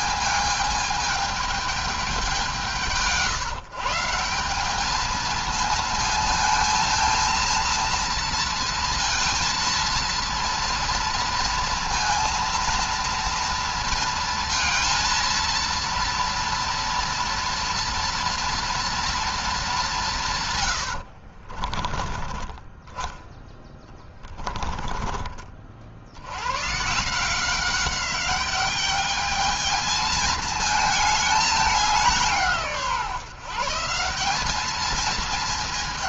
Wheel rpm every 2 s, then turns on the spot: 220, 170, 200, 230, 230, 230, 230, 230, 240, 240, 120, 20, 30, 120, 200, 220, 160, 210.
20-22 24-26